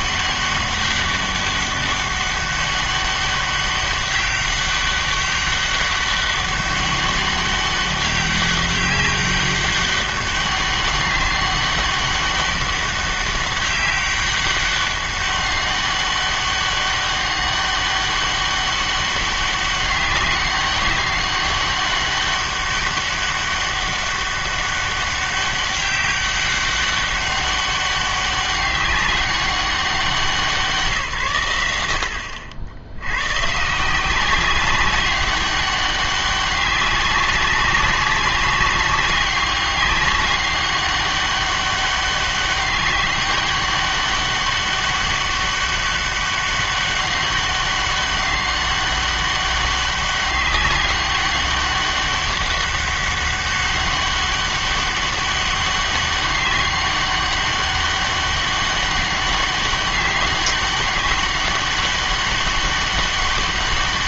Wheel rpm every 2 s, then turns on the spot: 200, 200, 200, 200, 200, 200, 200, 190, 200, 200, 190, 200, 200, 200, 200, 170, 70, 190, 200, 190, 200, 200, 200, 200, 200, 200, 200, 200, 200, 200, 200, 200.
none